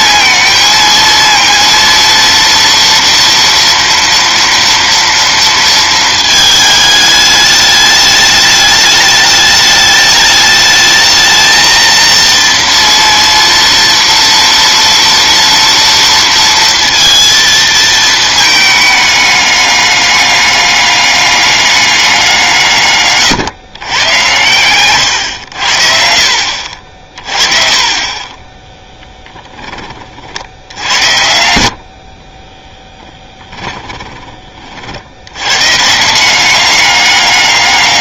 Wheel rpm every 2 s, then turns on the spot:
230, 230, 230, 220, 210, 210, 230, 230, 230, 220, 200, 150, 110, 50, 10, 80, 10, 40, 190.
28-30 32-34